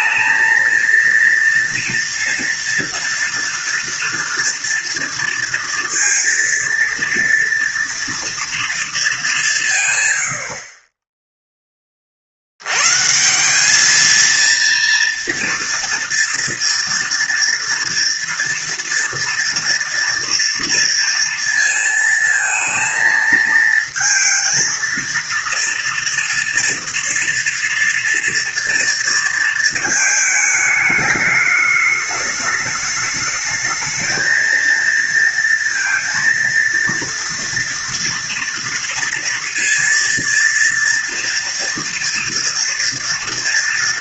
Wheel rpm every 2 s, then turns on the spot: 230, 230, 230, 230, 230, 60, 70, 230, 230, 230, 230, 220, 230, 240, 230, 220, 210, 230, 230, 230, 230, 230.
none